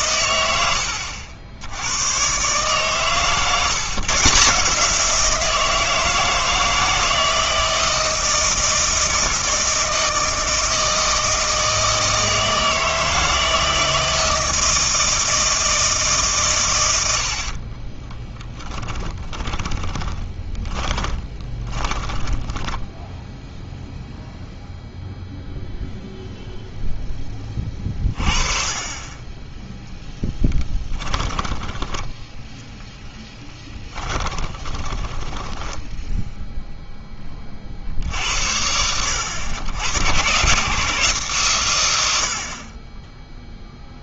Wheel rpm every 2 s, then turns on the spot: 90, 130, 160, 160, 160, 160, 160, 160, 130, 10, 10, 10, 0, 0, 30, 20, 10, 20, 0, 70, 140, 40.
18-24 30-32 34-36